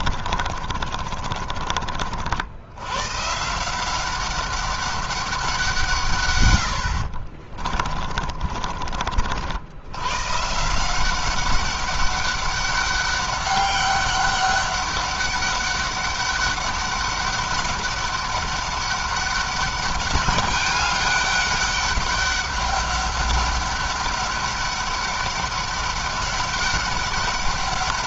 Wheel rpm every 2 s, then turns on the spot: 40, 100, 200, 80, 40, 160, 200, 200, 200, 200, 200, 200, 200, 200.
0-2